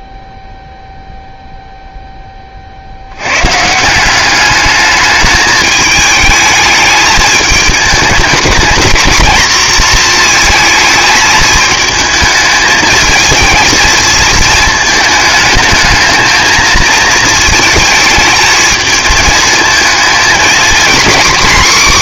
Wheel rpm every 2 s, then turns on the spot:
0, 110, 210, 220, 220, 220, 220, 220, 220, 220, 260.
none